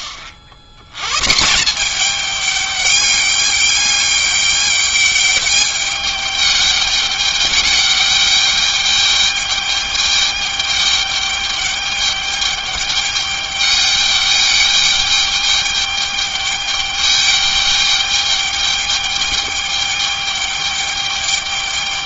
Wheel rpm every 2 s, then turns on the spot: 80, 210, 200, 210, 210, 210, 210, 210, 210, 210, 210.
none